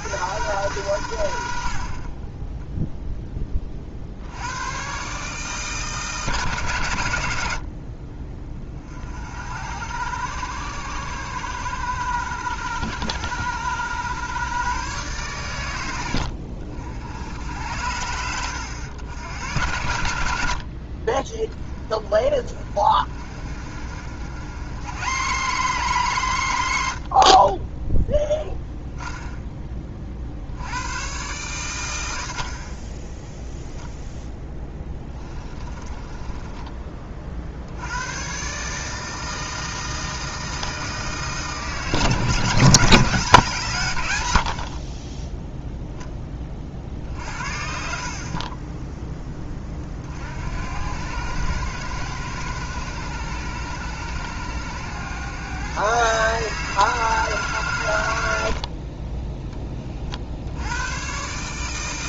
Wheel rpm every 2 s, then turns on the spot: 100, 0, 120, 120, 40, 110, 100, 130, 70, 100, 60, 40, 100, 80, 10, 90, 30, 10, 30, 150, 160, 170, 50, 40, 20, 90, 100, 110, 160, 40, 100.
34-36